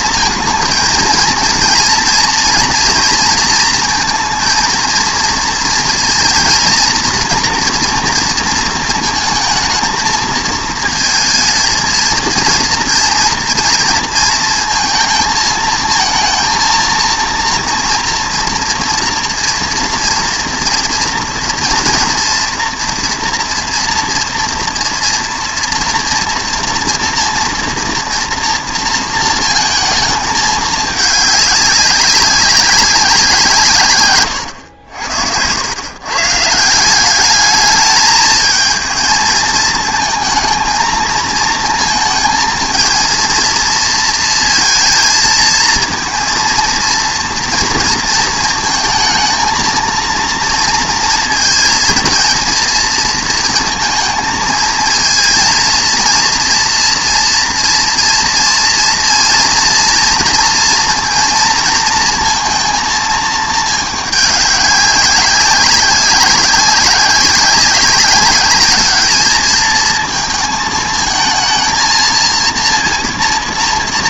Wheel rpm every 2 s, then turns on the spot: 230, 230, 230, 230, 230, 220, 240, 230, 230, 230, 230, 240, 240, 230, 230, 210, 190, 90, 180, 220, 220, 230, 230, 230, 220, 230, 230, 230, 230, 230, 230, 230, 190, 190, 210, 220, 230.
none